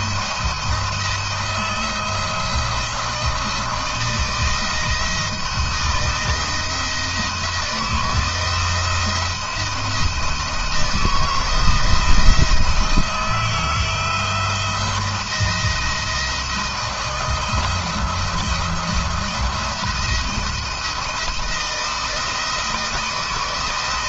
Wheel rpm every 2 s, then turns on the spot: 170, 170, 160, 160, 160, 160, 170, 170, 170, 170, 170, 160.
none